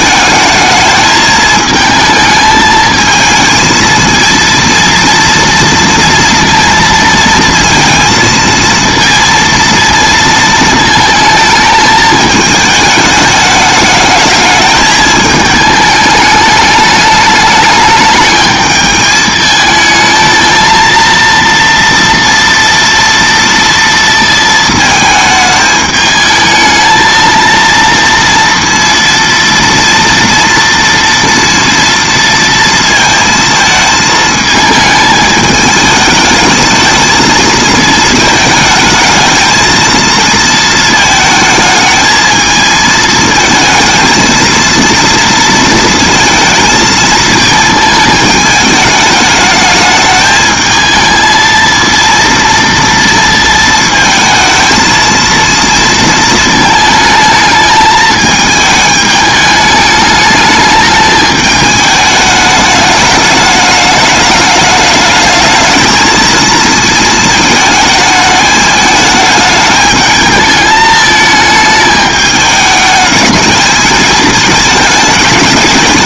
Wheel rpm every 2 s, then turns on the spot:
220, 220, 230, 230, 230, 220, 220, 220, 210, 220, 230, 230, 220, 220, 230, 240, 230, 220, 220, 220, 230, 220, 230, 230, 210, 220, 230, 230, 220, 210, 210, 210, 210, 220, 210, 220, 210, 210.
none